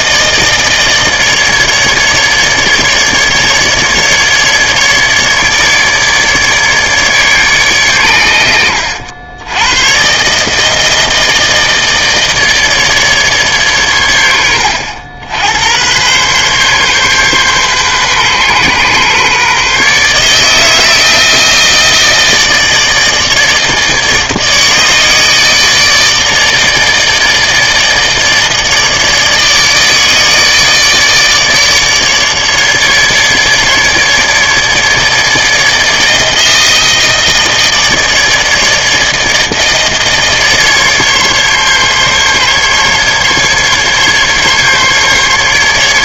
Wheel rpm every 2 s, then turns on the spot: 160, 150, 150, 150, 80, 150, 150, 80, 130, 130, 150, 160, 150, 160, 150, 150, 150, 150, 160, 160, 150, 140, 140.
none